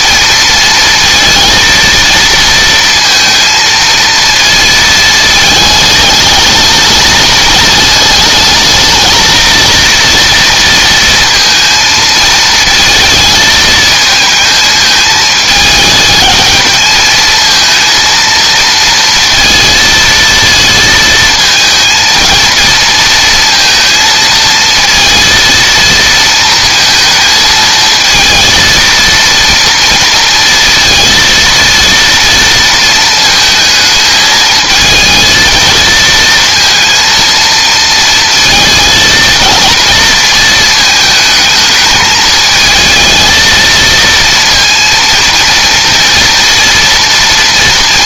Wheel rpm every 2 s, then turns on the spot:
230, 230, 220, 220, 220, 230, 220, 220, 220, 230, 230, 230, 230, 230, 230, 230, 230, 220, 230, 220, 220, 220, 230, 230.
none